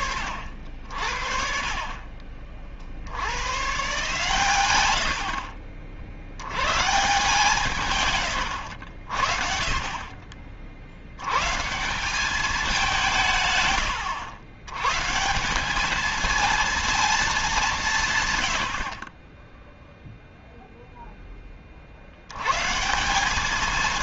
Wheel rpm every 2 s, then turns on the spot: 110, 70, 120, 60, 110, 150, 150, 210, 20, 10, 160, 50.
none